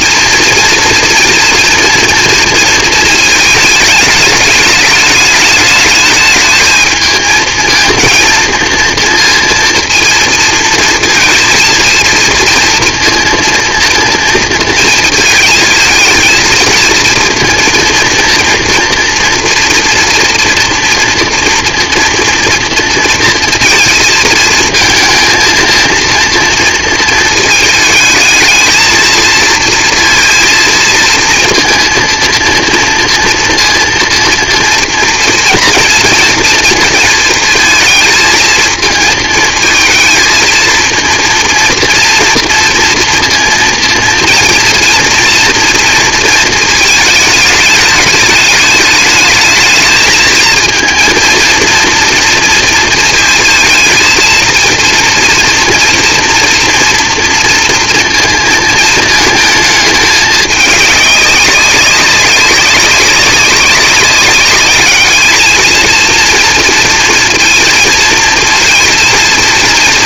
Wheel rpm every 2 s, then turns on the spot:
240, 230, 210, 220, 230, 230, 230, 230, 220, 230, 230, 230, 230, 230, 220, 230, 230, 230, 230, 220, 230, 230, 230, 220, 210, 220, 230, 230, 230, 230, 210, 200, 210, 230, 230.
none